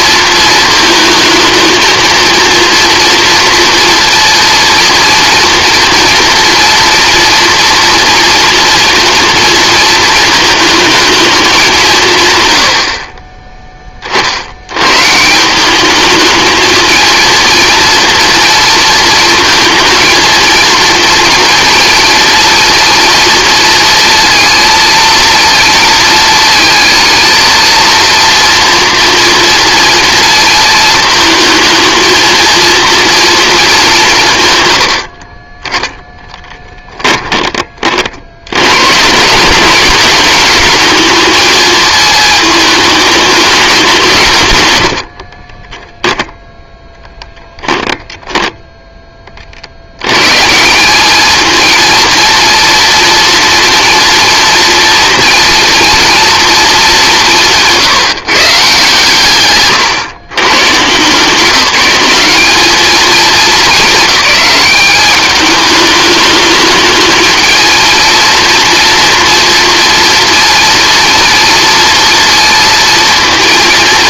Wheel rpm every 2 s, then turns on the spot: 220, 230, 230, 230, 230, 220, 70, 110, 220, 230, 230, 230, 230, 220, 230, 220, 230, 100, 10, 120, 220, 210, 90, 10, 10, 180, 230, 230, 220, 150, 130, 210, 210, 210, 230, 230, 230.
36-38 44-48